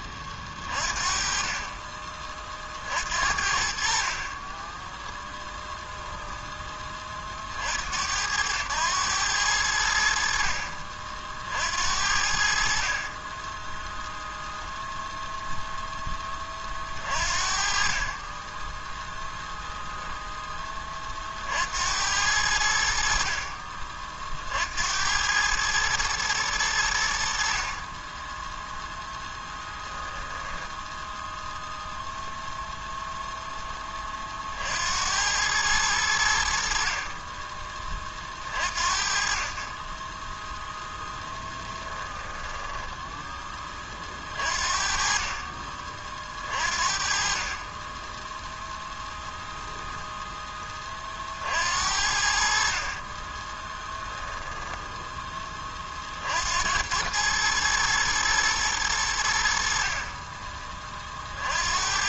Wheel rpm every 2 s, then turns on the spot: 30, 50, 10, 20, 100, 50, 40, 0, 40, 10, 30, 60, 80, 80, 0, 0, 0, 80, 40, 50, 10, 10, 40, 40, 0, 30, 40, 10, 90, 100, 40.
4-6 18-20 40-42 52-54